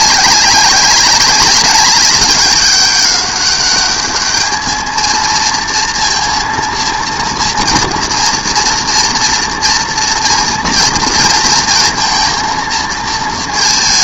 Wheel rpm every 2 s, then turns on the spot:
190, 190, 220, 230, 230, 230, 230.
none